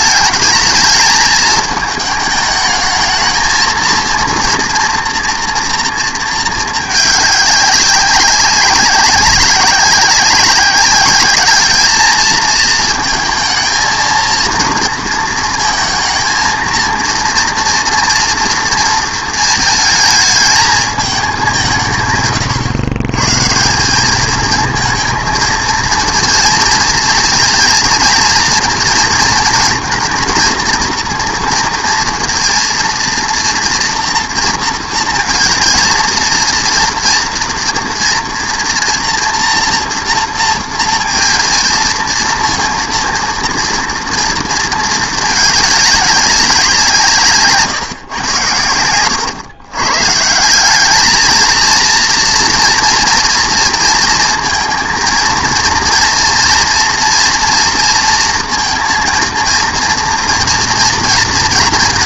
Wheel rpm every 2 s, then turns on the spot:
220, 220, 230, 220, 190, 190, 220, 230, 230, 230, 220, 130, 220, 230, 230, 230, 230, 230, 230, 230, 230, 230, 230, 180, 100, 180, 230, 220, 230, 230, 230.
none